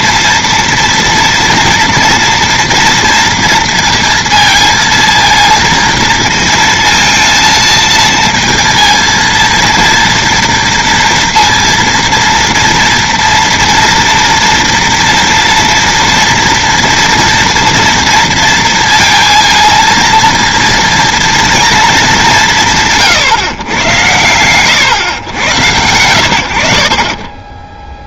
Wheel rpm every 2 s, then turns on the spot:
230, 230, 230, 230, 230, 230, 240, 230, 230, 230, 230, 170, 120, 60.
none